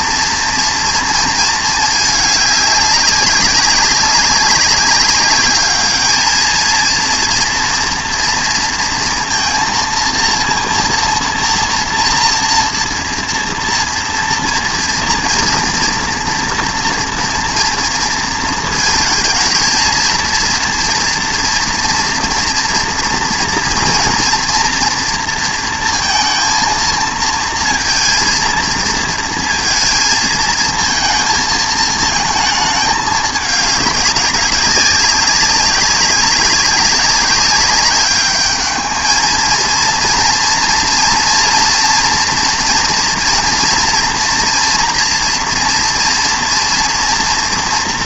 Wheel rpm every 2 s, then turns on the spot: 230, 200, 200, 230, 230, 230, 230, 230, 230, 230, 230, 230, 230, 230, 230, 230, 220, 200, 200, 220, 230, 230, 240, 230.
none